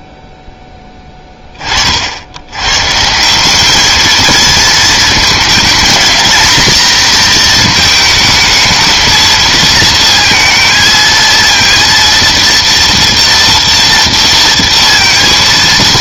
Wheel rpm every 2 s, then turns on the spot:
10, 110, 220, 230, 220, 230, 230, 230.
none